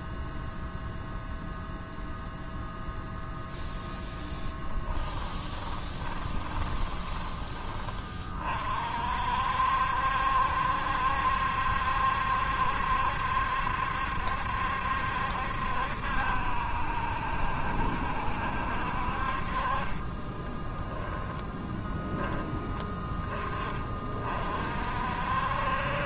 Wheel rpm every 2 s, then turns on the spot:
0, 0, 10, 20, 50, 70, 70, 70, 70, 60, 20, 10, 50.
4-8 20-22